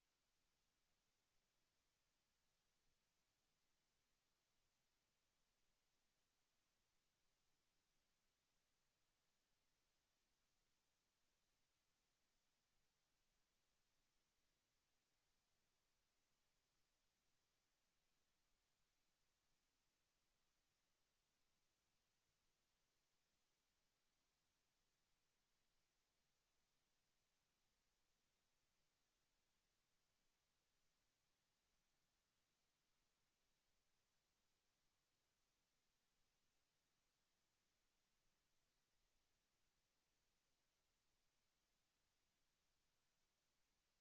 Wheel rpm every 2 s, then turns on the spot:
0, 0, 0, 0, 0, 0, 0, 0, 0, 0, 0, 0, 0, 0, 0, 0, 0, 0, 0, 0, 0, 0.
none